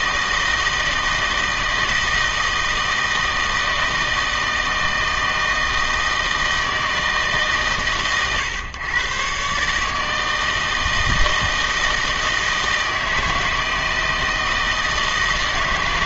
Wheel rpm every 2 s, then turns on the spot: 160, 160, 160, 160, 120, 160, 160, 160.
none